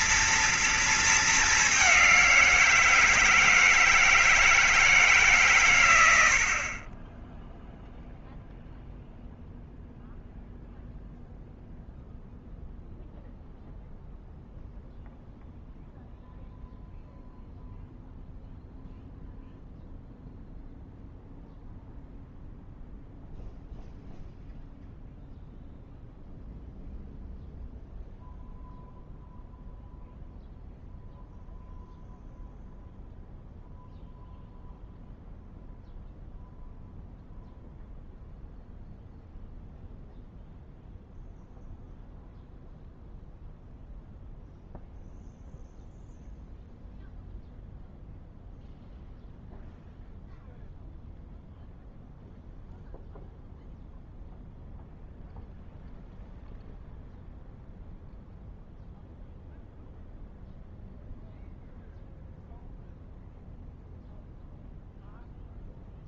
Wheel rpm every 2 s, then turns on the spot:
220, 170, 150, 30, 0, 0, 0, 0, 0, 0, 0, 0, 0, 0, 0, 0, 0, 0, 0, 0, 0, 0, 0, 0, 0, 0, 0, 0, 0, 0, 0, 0, 10.
none